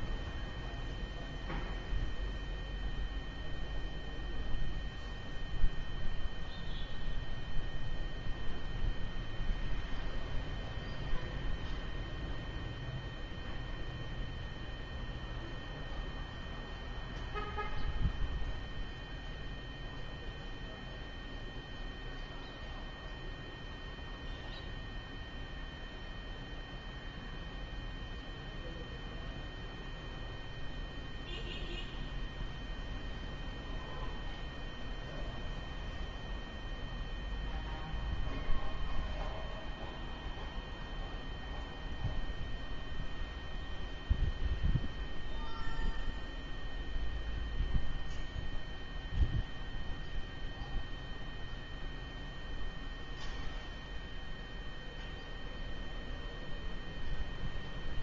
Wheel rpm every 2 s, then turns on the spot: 0, 0, 0, 0, 0, 0, 0, 0, 0, 0, 0, 0, 0, 0, 0, 0, 0, 0, 0, 0, 0, 0, 0, 0, 0, 0, 0, 0, 0.
none